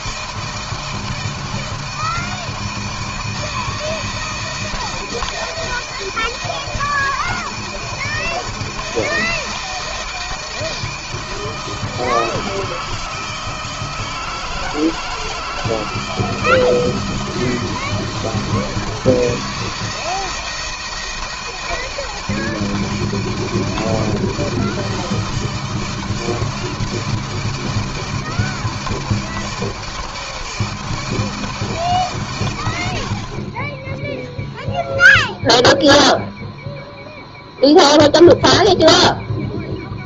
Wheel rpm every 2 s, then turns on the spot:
160, 160, 160, 160, 160, 160, 160, 160, 170, 160, 160, 160, 160, 160, 160, 170, 110, 0, 0, 0.
none